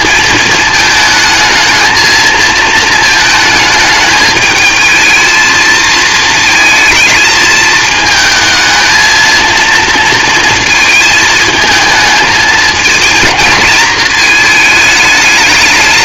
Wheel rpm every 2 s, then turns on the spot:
220, 220, 220, 220, 220, 220, 220, 210.
none